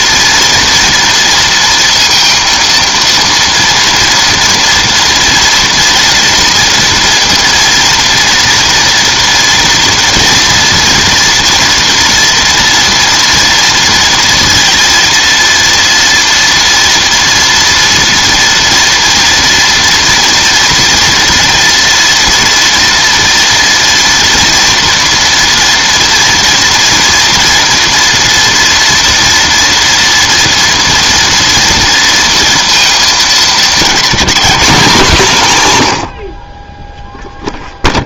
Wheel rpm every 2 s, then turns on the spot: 230, 230, 230, 230, 230, 230, 230, 230, 240, 240, 230, 230, 230, 230, 230, 230, 220, 190, 0.
none